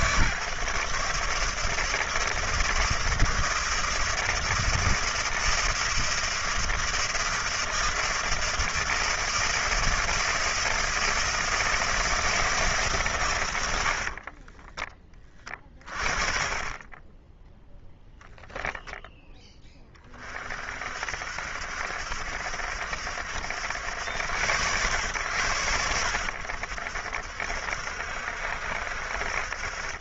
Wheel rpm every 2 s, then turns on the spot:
150, 160, 160, 160, 160, 160, 160, 40, 20, 0, 40, 70, 100, 90, 70.
14-16